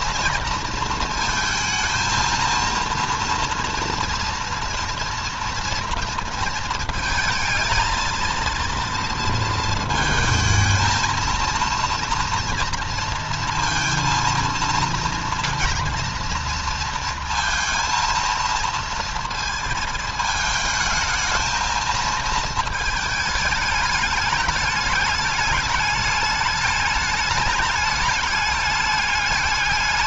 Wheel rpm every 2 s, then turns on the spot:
230, 230, 230, 220, 230, 230, 230, 230, 230, 230, 220, 220, 210, 210, 210.
none